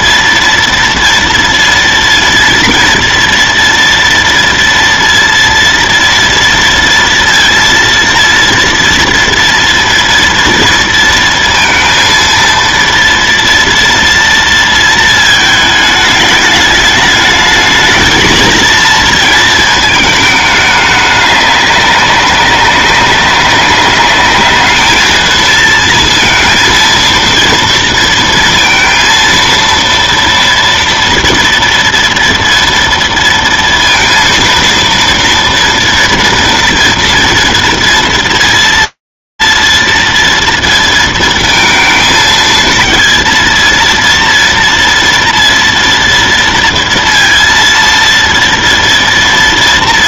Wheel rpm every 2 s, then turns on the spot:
230, 230, 230, 230, 230, 230, 230, 230, 210, 230, 210, 190, 220, 230, 230, 230, 230, 230, 230, 230, 230, 230, 230, 230, 230.
none